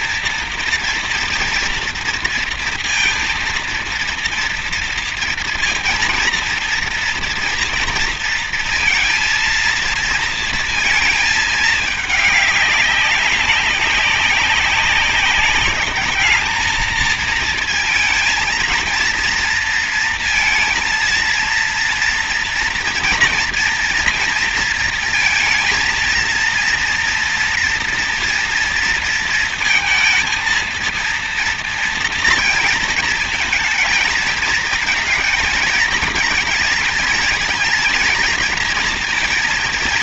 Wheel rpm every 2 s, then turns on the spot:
230, 230, 230, 230, 230, 230, 200, 200, 220, 230, 230, 230, 230, 230, 230, 230, 220, 230, 220, 230.
none